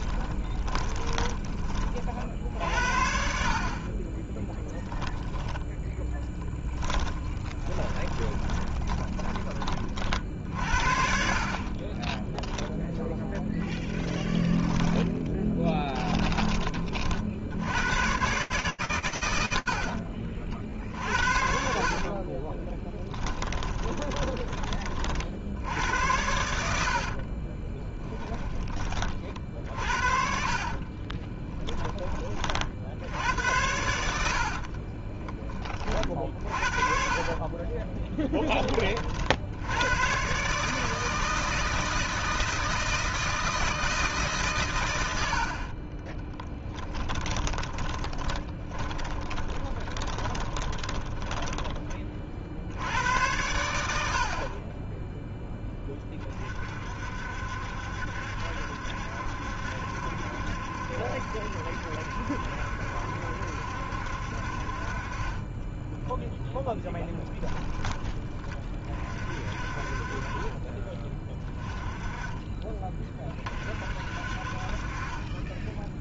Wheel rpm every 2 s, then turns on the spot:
20, 60, 20, 10, 20, 60, 0, 20, 30, 90, 60, 20, 50, 60, 40, 30, 80, 10, 50, 60, 160, 160, 50, 10, 20, 10, 100, 10, 60, 70, 70, 70, 40, 10, 40, 20, 20, 40.
0-2 6-10 14-16 22-24 26-28 30-32 36-38 46-52